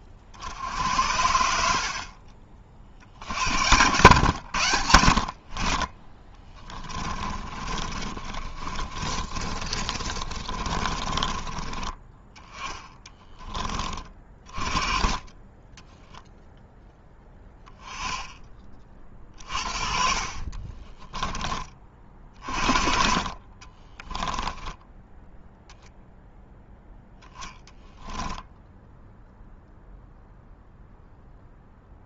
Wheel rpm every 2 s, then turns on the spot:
40, 40, 90, 20, 30, 30, 20, 30, 0, 20, 30, 50, 10, 0, 0, 0.
6-14 20-22 24-26